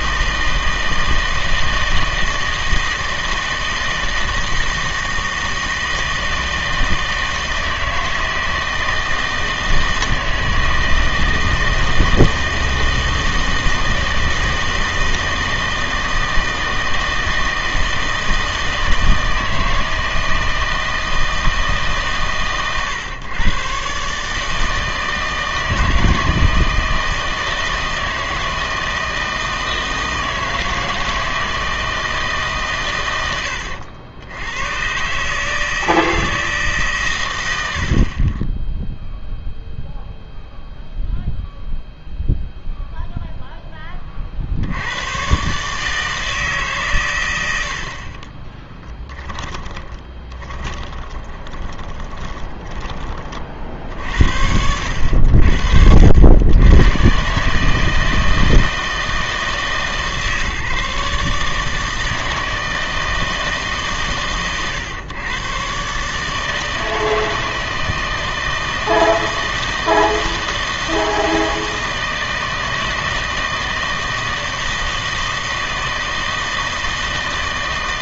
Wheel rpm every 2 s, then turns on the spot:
160, 160, 160, 160, 160, 160, 160, 160, 160, 160, 160, 120, 160, 160, 160, 160, 130, 120, 150, 10, 0, 0, 80, 140, 10, 20, 20, 70, 110, 160, 150, 160, 120, 160, 160, 160, 160, 160, 160.
48-52